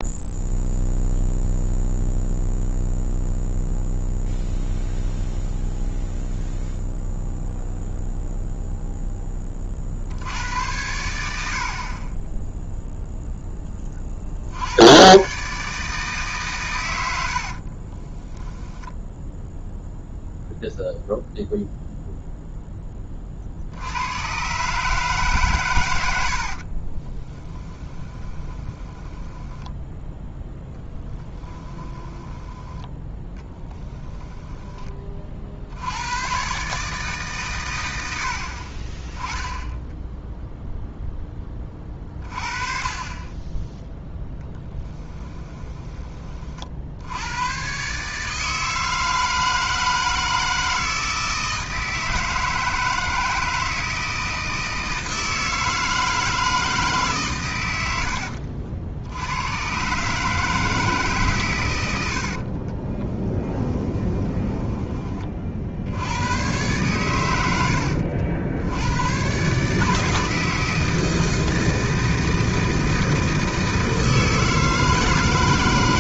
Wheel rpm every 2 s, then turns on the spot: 0, 0, 0, 0, 0, 90, 0, 80, 120, 20, 0, 10, 140, 50, 20, 0, 10, 10, 140, 40, 0, 30, 10, 60, 160, 160, 160, 160, 160, 70, 150, 30, 20, 110, 90, 160, 160, 160.
18-20 26-30 44-46 62-66